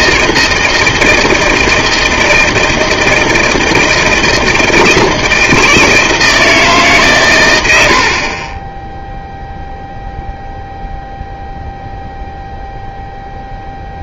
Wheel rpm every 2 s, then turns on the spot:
160, 160, 160, 160, 20, 0, 0.
8-10